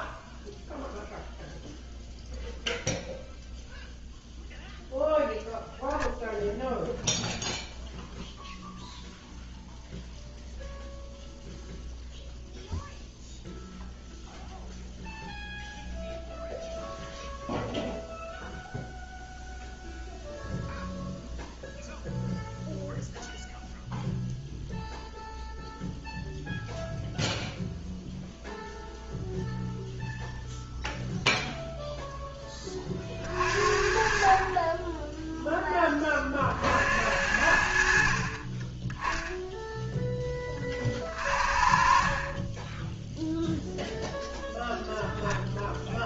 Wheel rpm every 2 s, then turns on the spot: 0, 0, 0, 0, 0, 0, 0, 0, 0, 0, 0, 0, 0, 0, 0, 0, 20, 30, 60, 10, 30, 10, 0.
none